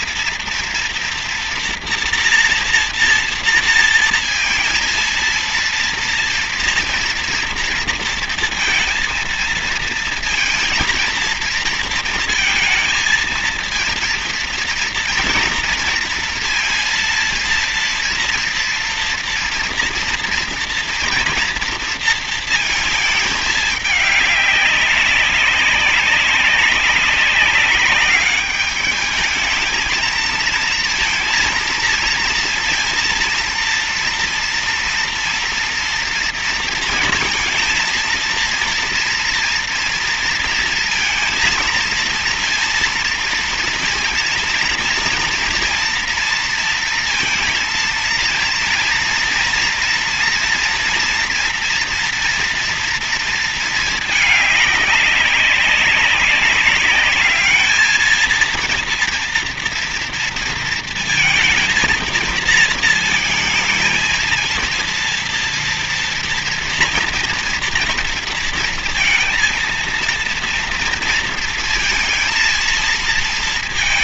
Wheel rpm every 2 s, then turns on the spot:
230, 240, 230, 230, 230, 230, 230, 230, 230, 230, 230, 230, 200, 190, 200, 230, 230, 230, 230, 230, 230, 230, 230, 230, 230, 230, 230, 210, 200, 230, 230, 220, 230, 230, 230, 230, 230.
none